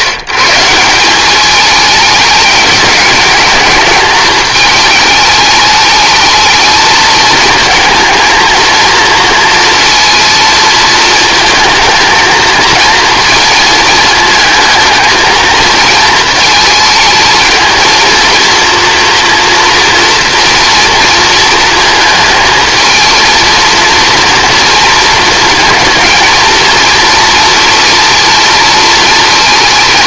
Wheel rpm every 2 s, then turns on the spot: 160, 210, 220, 220, 230, 230, 220, 220, 220, 230, 230, 220, 230, 230, 230.
none